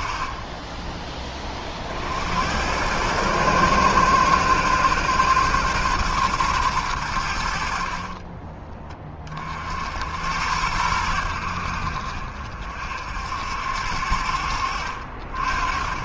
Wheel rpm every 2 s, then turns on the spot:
20, 110, 130, 100, 20, 90, 60, 60.
none